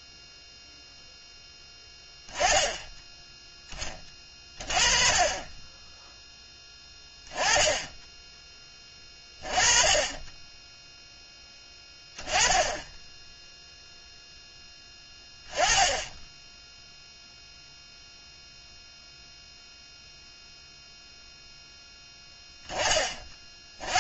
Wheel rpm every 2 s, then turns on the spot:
0, 10, 30, 10, 20, 10, 10, 10, 0, 0, 0, 10.
none